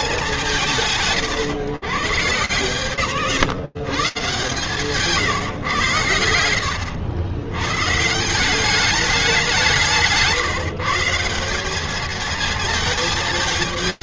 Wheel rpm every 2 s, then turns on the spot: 150, 150, 120, 100, 180, 180, 200.
none